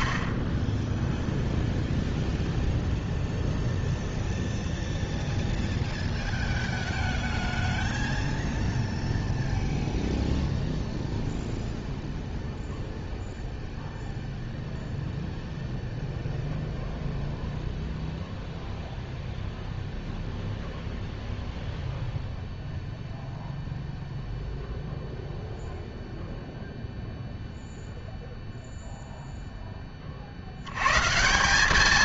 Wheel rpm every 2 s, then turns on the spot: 10, 0, 0, 0, 0, 0, 0, 0, 0, 0, 0, 0, 0, 0, 0, 80.
none